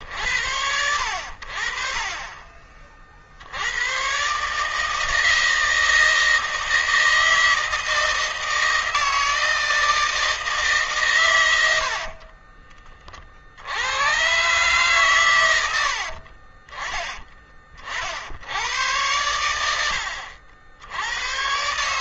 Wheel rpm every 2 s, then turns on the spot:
80, 40, 150, 160, 160, 140, 30, 130, 20, 110, 80.
none